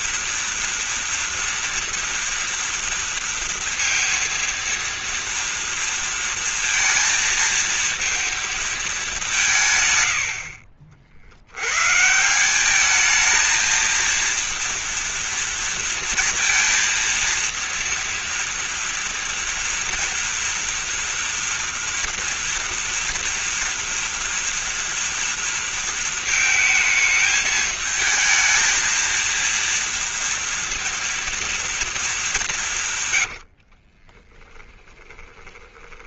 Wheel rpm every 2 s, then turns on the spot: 230, 230, 230, 230, 220, 60, 200, 230, 230, 230, 230, 230, 230, 220, 220, 230, 150, 10.
34-36